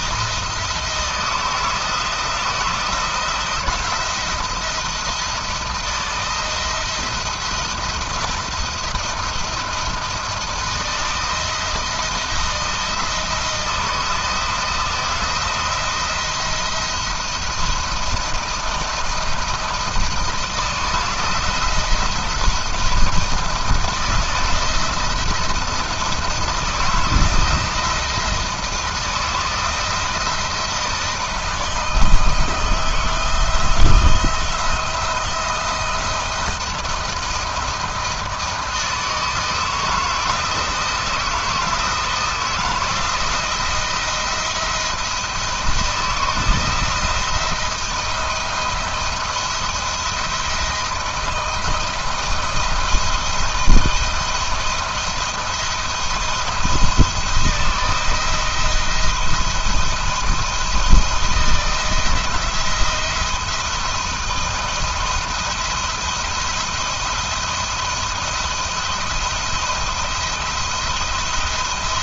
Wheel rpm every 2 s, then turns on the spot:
170, 170, 170, 160, 170, 160, 160, 170, 170, 170, 160, 160, 160, 160, 170, 160, 160, 170, 170, 160, 160, 160, 170, 160, 170, 170, 160, 170, 170, 170, 160, 170, 170, 170, 170, 170.
none